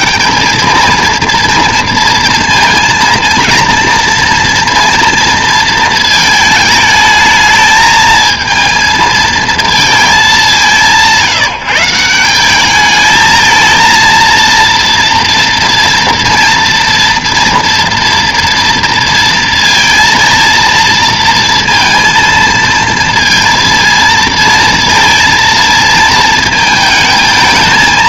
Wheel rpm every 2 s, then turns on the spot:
210, 230, 230, 220, 220, 190, 210, 230, 230, 230, 230, 230, 230, 220.
none